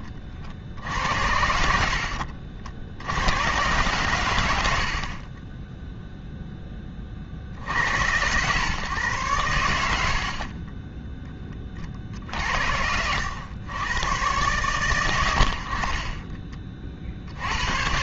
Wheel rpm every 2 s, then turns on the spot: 70, 60, 80, 0, 120, 40, 70, 120, 30.
none